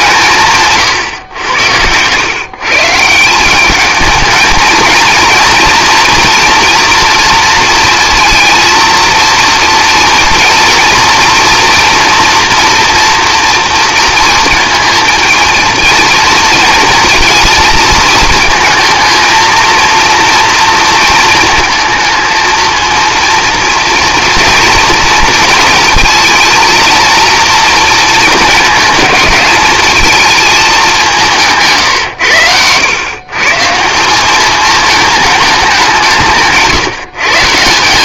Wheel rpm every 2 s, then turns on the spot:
120, 160, 220, 230, 230, 230, 240, 230, 230, 220, 230, 230, 230, 230, 220, 200, 110, 210, 140.
0-2